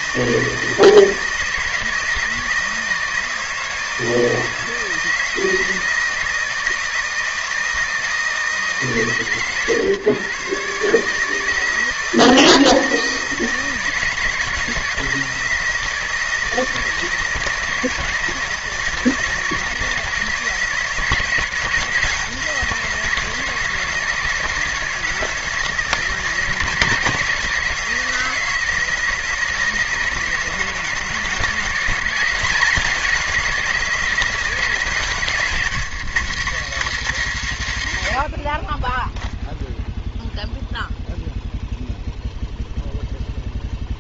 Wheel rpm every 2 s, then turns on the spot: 160, 160, 160, 160, 150, 150, 160, 160, 160, 160, 170, 170, 160, 160, 160, 160, 180, 170, 230, 50, 0, 0.
none